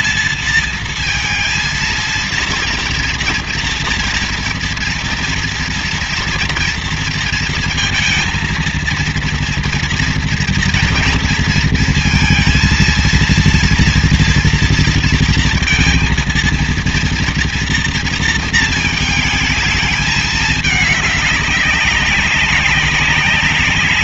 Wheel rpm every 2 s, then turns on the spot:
230, 230, 230, 230, 230, 230, 230, 230, 230, 220, 210, 200.
none